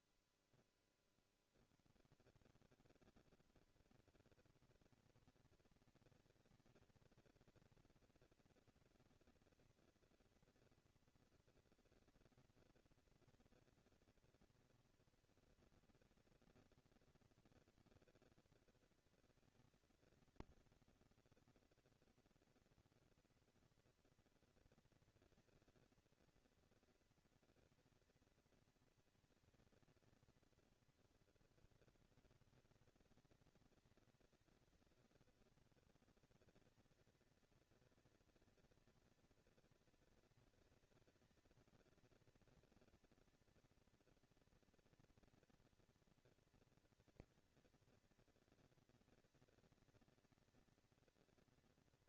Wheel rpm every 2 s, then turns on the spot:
0, 150, 220, 220, 230, 230, 230, 230, 230, 230, 230, 230, 230, 230, 230, 220, 190, 190, 210, 230, 230, 230, 230, 230, 230, 230.
none